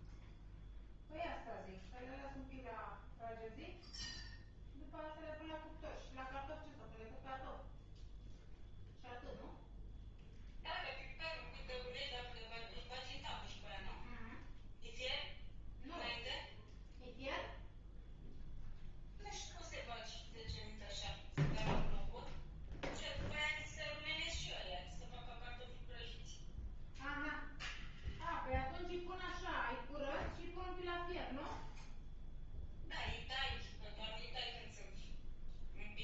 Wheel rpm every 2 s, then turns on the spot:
0, 0, 0, 0, 0, 0, 0, 0, 0, 0, 0, 0, 0, 0, 0, 0, 0, 0.
none